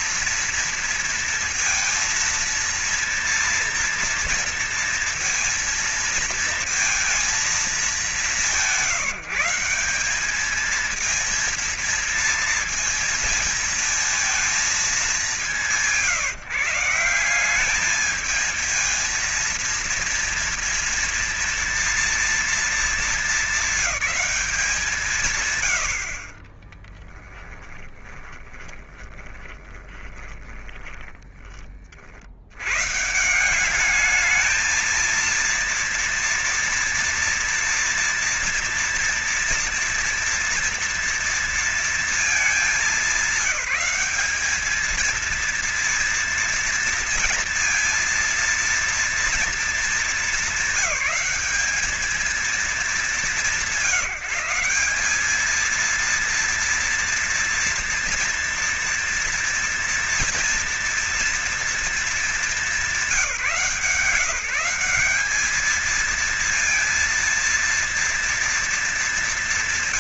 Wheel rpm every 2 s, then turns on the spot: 230, 230, 230, 230, 160, 210, 230, 210, 160, 220, 230, 220, 180, 30, 20, 20, 120, 220, 230, 230, 230, 200, 210, 230, 230, 210, 210, 190, 230, 240, 230, 190, 180, 230, 210.
26-32